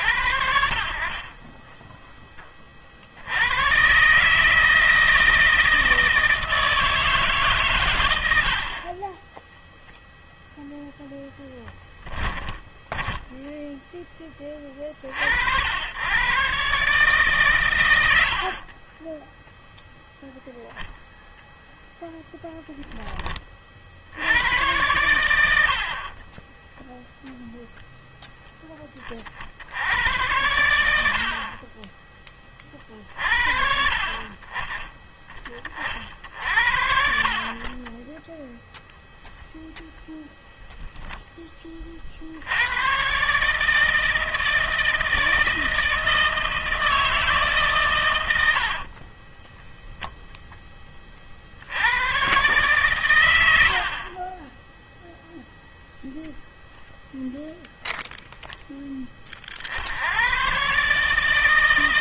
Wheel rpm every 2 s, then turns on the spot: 30, 40, 160, 160, 30, 0, 10, 30, 130, 40, 0, 10, 100, 10, 20, 80, 40, 30, 60, 0, 0, 120, 160, 160, 40, 20, 120, 0, 0, 10, 140.
12-14 18-20 48-50